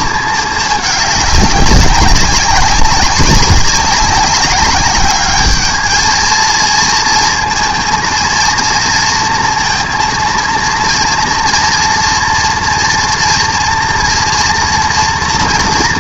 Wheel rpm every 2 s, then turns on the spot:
210, 190, 200, 230, 230, 230, 230, 230.
none